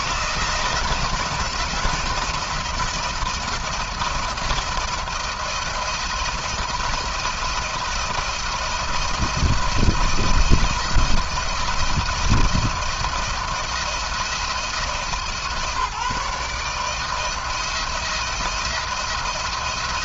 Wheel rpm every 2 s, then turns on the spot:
160, 170, 170, 170, 170, 170, 170, 160, 160, 170.
none